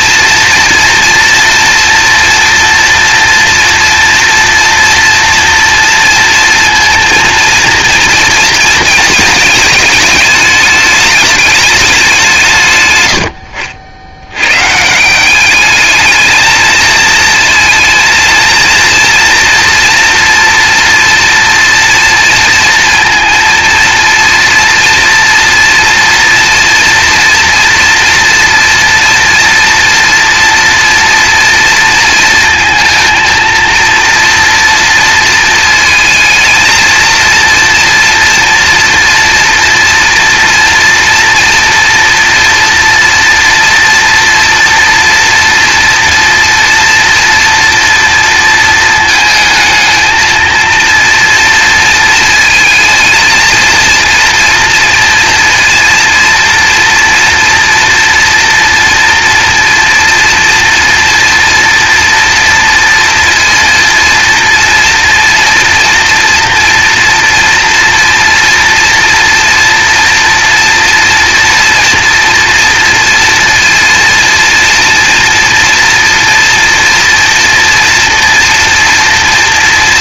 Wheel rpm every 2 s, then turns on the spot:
230, 230, 230, 230, 230, 220, 140, 130, 220, 230, 230, 230, 230, 230, 230, 240, 230, 230, 220, 230, 230, 230, 240, 240, 230, 230, 220, 230, 230, 230, 230, 230, 230, 230, 230, 230, 230, 230, 230, 230.
none